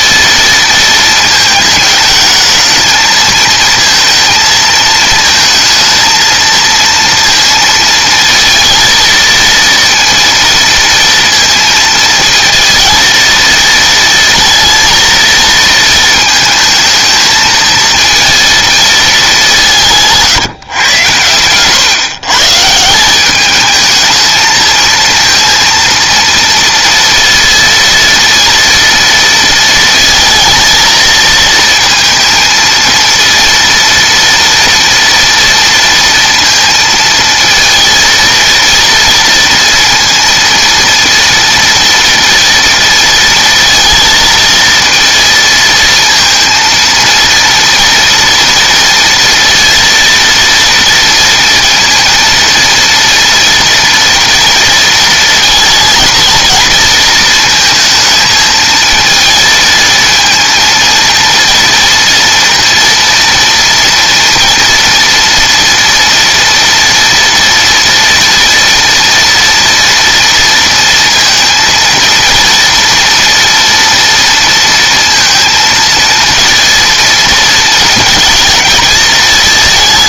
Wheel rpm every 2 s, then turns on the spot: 230, 220, 230, 230, 230, 230, 220, 230, 230, 230, 150, 140, 220, 230, 230, 230, 230, 230, 230, 230, 230, 230, 230, 230, 230, 230, 230, 240, 230, 220, 230, 230, 230, 230, 240, 240, 230, 230, 230, 220.
none